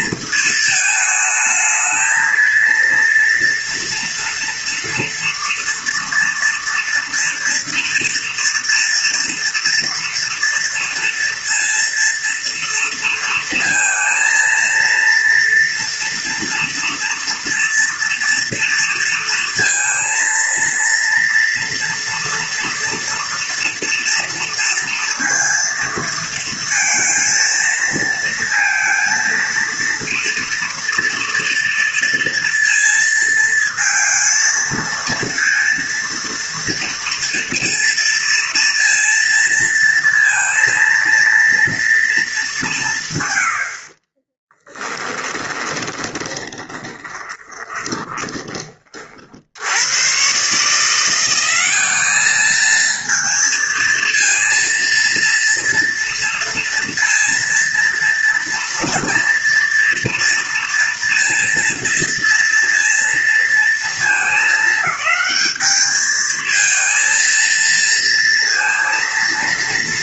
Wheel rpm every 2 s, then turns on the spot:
220, 230, 230, 240, 240, 230, 230, 230, 230, 230, 230, 240, 230, 230, 230, 230, 220, 230, 230, 230, 230, 130, 10, 20, 40, 170, 220, 230, 230, 230, 230, 230, 210, 230, 230.
44-48